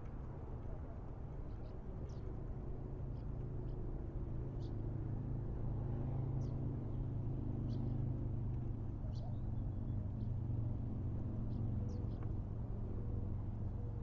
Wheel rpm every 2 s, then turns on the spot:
0, 0, 0, 0, 0, 0, 0.
none